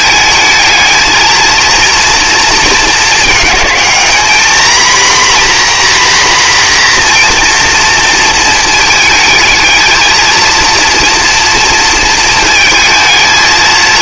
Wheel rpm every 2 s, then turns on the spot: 220, 230, 240, 250, 220, 230, 220.
none